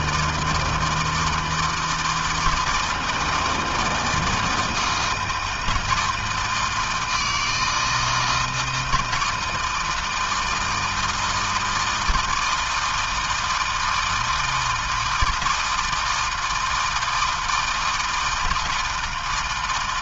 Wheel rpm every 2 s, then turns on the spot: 160, 160, 160, 160, 160, 160, 170, 160, 160, 160.
none